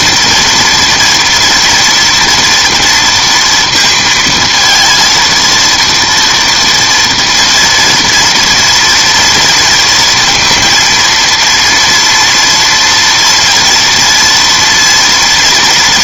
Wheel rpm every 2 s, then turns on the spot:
230, 230, 230, 230, 240, 230, 230, 230.
none